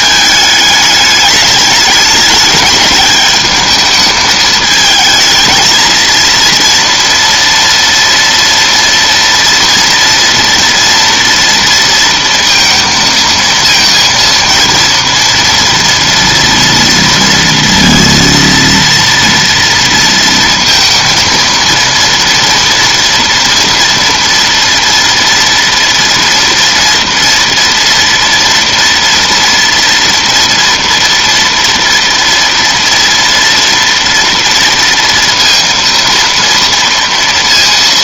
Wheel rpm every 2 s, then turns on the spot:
210, 210, 220, 230, 230, 230, 230, 230, 230, 230, 230, 230, 230, 230, 230, 230, 230, 230, 230.
none